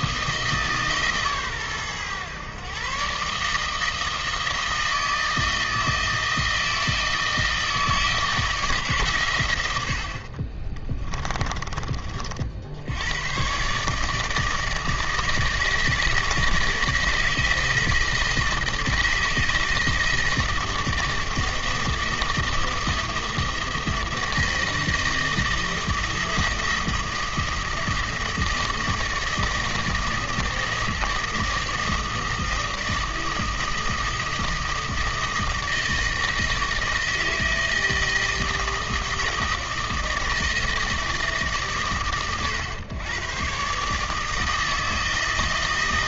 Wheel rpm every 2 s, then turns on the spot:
150, 130, 160, 160, 150, 20, 70, 160, 160, 160, 160, 160, 160, 160, 160, 160, 160, 160, 160, 160, 160, 120, 160.
10-12